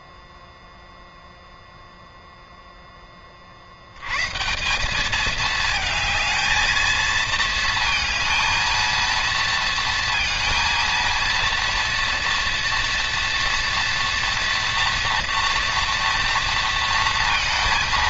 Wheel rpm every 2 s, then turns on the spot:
0, 0, 140, 220, 230, 230, 230, 230, 230.
none